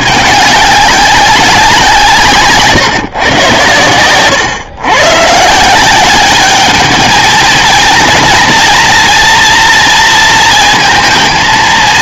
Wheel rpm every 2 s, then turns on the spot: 200, 150, 120, 200, 230, 230.
none